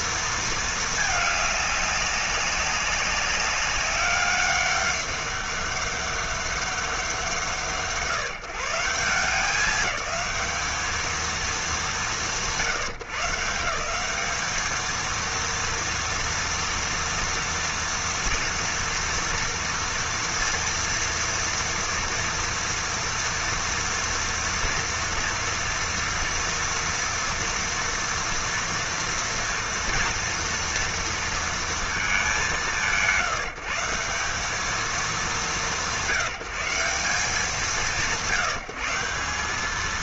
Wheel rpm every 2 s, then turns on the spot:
210, 190, 200, 170, 180, 220, 160, 230, 230, 240, 230, 230, 230, 230, 230, 230, 140, 210, 170, 160.
none